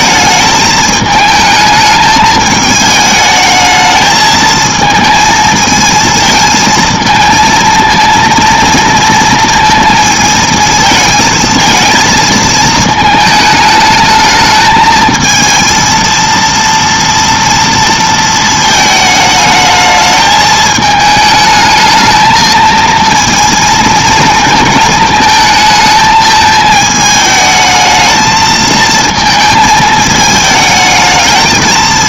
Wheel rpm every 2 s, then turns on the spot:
220, 220, 220, 220, 230, 220, 230, 220, 230, 220, 220, 220, 220, 220, 220, 220.
none